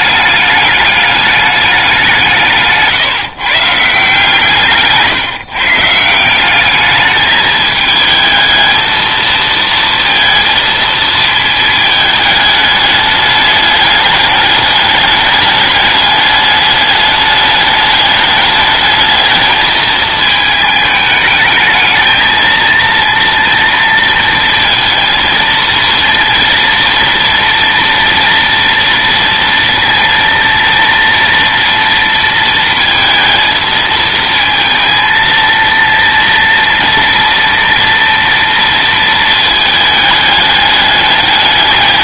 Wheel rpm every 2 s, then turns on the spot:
210, 160, 160, 200, 220, 230, 210, 210, 210, 210, 210, 230, 230, 230, 230, 230, 220, 230, 230, 230, 210.
none